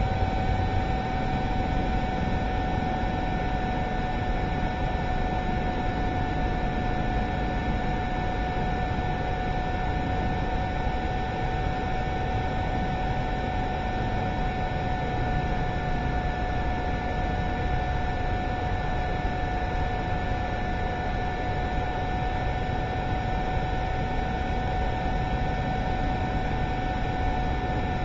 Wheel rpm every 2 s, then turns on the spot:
0, 0, 0, 0, 0, 0, 0, 0, 0, 0, 0, 0, 0, 0.
none